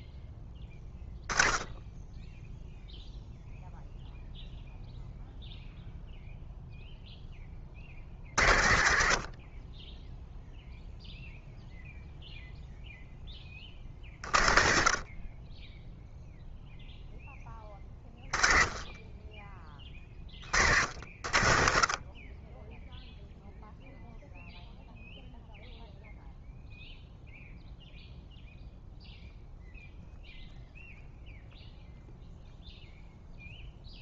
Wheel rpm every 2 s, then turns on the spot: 10, 0, 0, 0, 70, 0, 0, 50, 0, 20, 50, 10, 0, 0, 0, 0, 0.
none